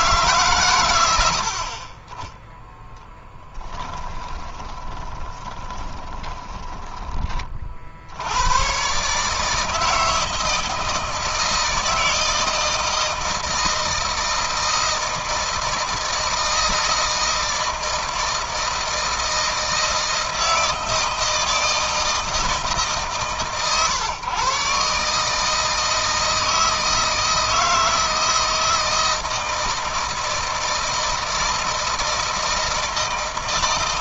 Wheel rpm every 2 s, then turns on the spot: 110, 0, 20, 10, 120, 160, 160, 160, 160, 160, 160, 150, 140, 160, 160, 160, 160.
4-8